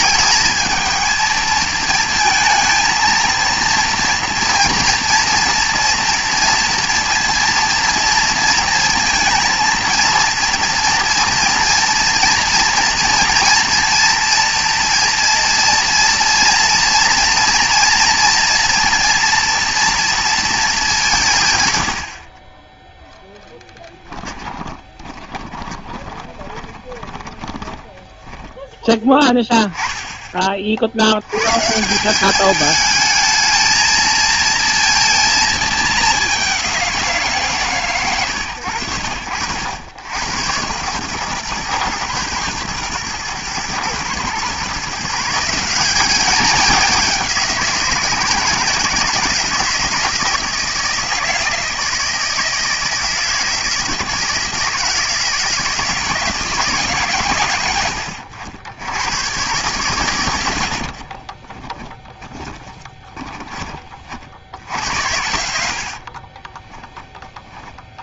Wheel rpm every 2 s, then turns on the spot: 220, 220, 230, 230, 230, 230, 230, 230, 230, 230, 210, 10, 20, 20, 10, 50, 210, 230, 190, 100, 110, 120, 140, 200, 160, 160, 160, 160, 160, 80, 70, 20, 70, 20.
24-28 60-64 66-68